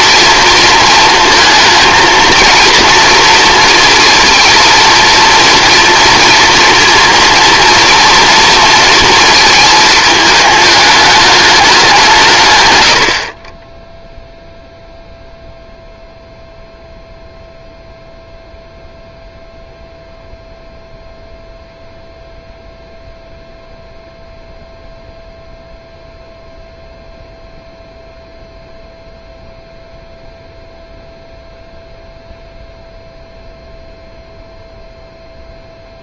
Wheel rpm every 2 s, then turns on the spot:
230, 230, 230, 230, 230, 210, 100, 0, 0, 0, 0, 0, 0, 0, 0, 0, 0, 0.
none